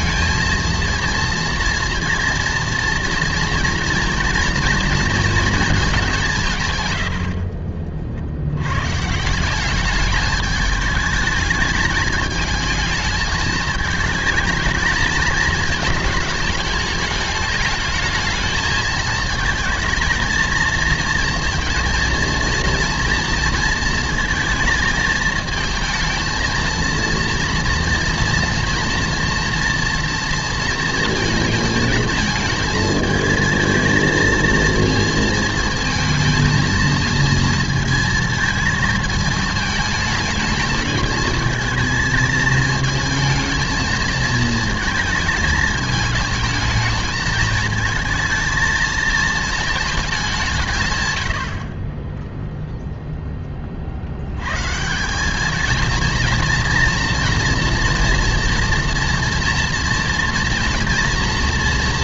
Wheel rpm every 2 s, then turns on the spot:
220, 230, 230, 150, 100, 210, 220, 220, 220, 220, 230, 230, 220, 230, 230, 230, 220, 230, 220, 220, 210, 220, 220, 220, 220, 160, 0, 120, 230, 230, 230.
none